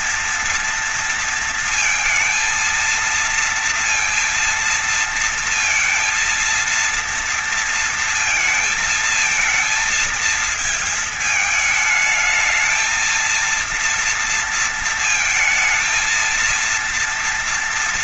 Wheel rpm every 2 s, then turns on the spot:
230, 230, 230, 230, 230, 220, 220, 220, 230.
none